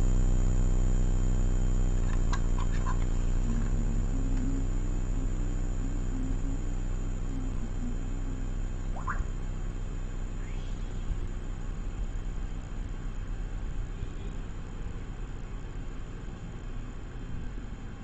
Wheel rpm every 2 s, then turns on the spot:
0, 0, 0, 0, 0, 0, 0, 0, 0.
none